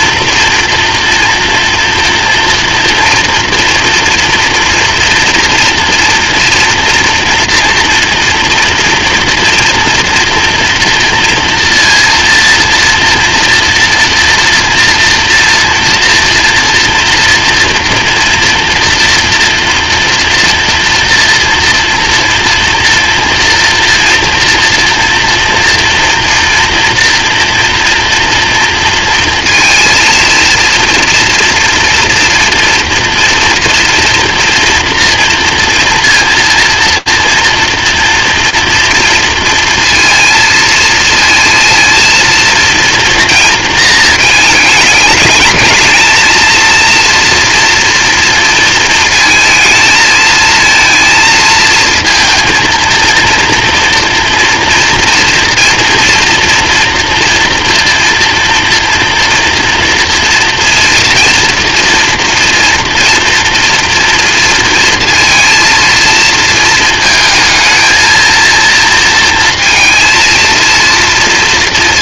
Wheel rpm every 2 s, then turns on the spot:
230, 230, 230, 240, 230, 230, 230, 230, 230, 230, 230, 230, 230, 230, 230, 230, 230, 240, 230, 230, 230, 230, 210, 230, 230, 230, 230, 240, 230, 230, 230, 230, 230, 220, 230, 230.
none